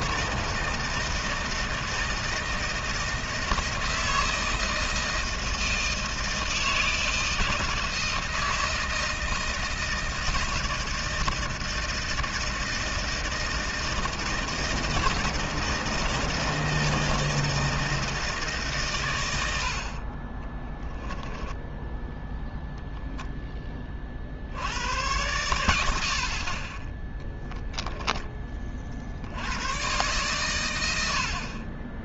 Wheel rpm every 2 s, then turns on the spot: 160, 160, 160, 160, 160, 160, 160, 160, 160, 140, 30, 0, 80, 30, 30, 100.
20-22